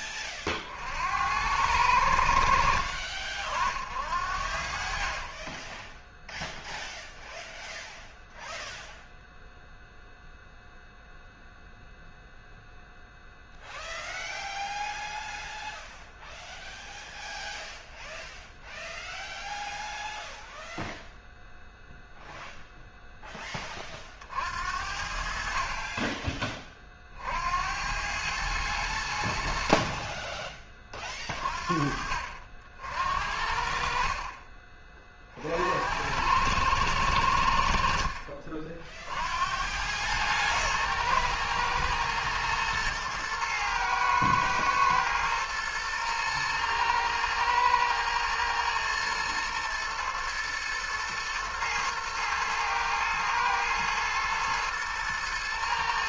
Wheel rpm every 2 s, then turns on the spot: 50, 70, 50, 0, 0, 0, 0, 0, 0, 0, 0, 0, 70, 30, 100, 30, 70, 30, 100, 50, 110, 110, 110, 110, 120, 120, 110, 110.
2-4